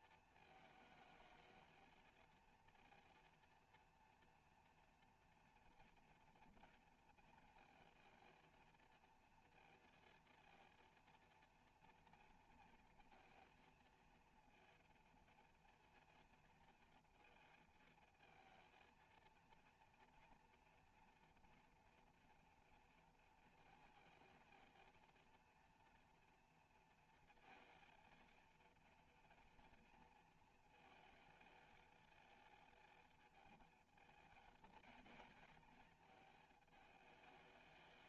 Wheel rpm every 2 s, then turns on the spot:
220, 230, 240, 230, 230, 230, 230, 230, 230, 230, 230, 230, 230, 230, 230, 230, 230, 230, 220.
none